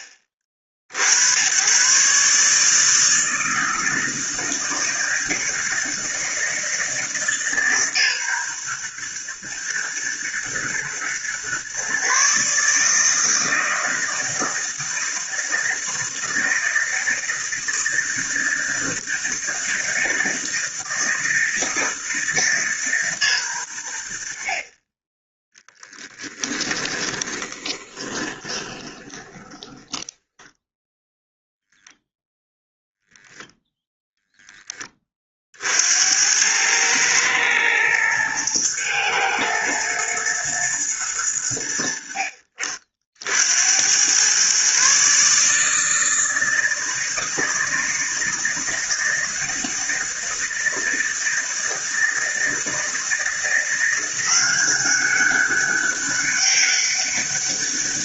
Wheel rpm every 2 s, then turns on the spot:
50, 160, 160, 160, 120, 120, 150, 160, 160, 160, 160, 140, 30, 10, 20, 0, 10, 30, 110, 110, 110, 50, 140, 160, 160, 160, 160, 190, 200.
26-30